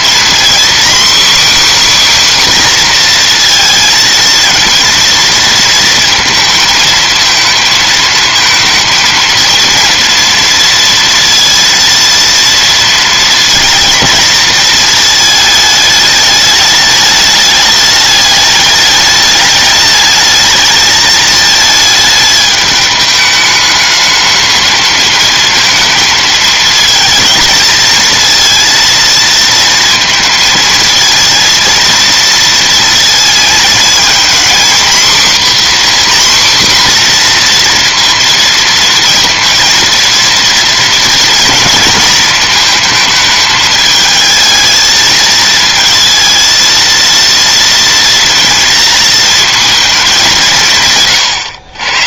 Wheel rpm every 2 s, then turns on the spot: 260, 250, 230, 220, 230, 230, 230, 220, 210, 210, 220, 210, 220, 220, 230, 220, 230, 240, 250, 230, 240, 220, 220, 230, 230, 150.
none